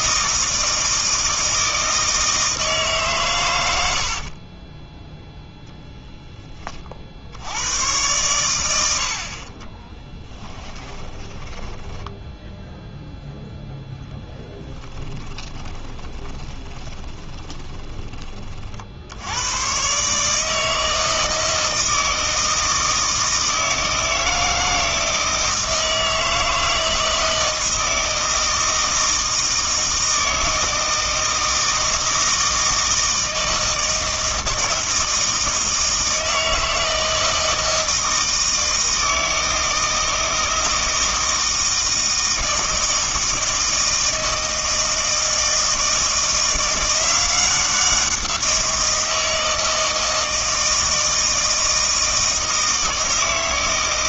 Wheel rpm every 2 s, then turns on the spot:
160, 140, 10, 30, 80, 20, 0, 10, 20, 60, 160, 160, 160, 160, 160, 160, 160, 160, 160, 160, 160, 160, 160, 180, 170, 160, 160.
4-6 10-12 14-18